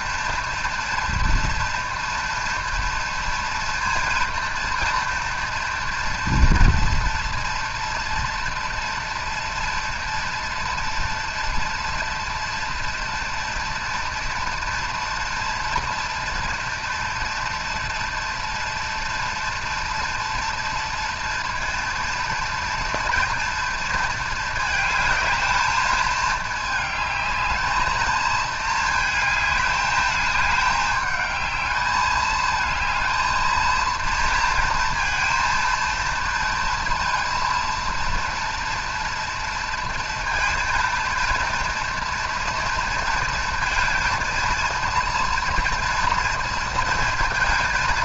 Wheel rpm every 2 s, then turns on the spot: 230, 230, 230, 230, 230, 240, 230, 230, 230, 240, 230, 230, 220, 210, 220, 210, 220, 230, 230, 230, 230, 230, 230, 230.
none